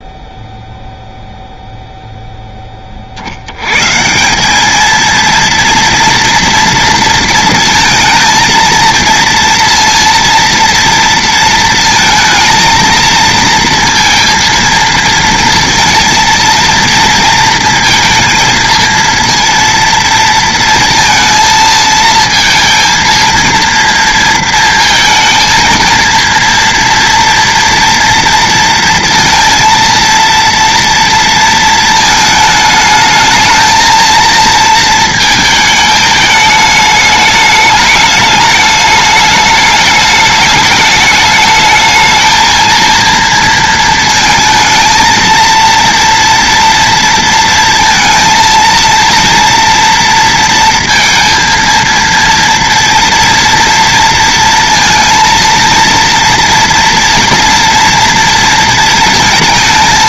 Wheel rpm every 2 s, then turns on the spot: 0, 20, 210, 230, 230, 230, 230, 230, 230, 230, 230, 230, 230, 230, 230, 230, 220, 220, 210, 210, 210, 230, 220, 230, 230, 230, 230, 230, 240, 230.
none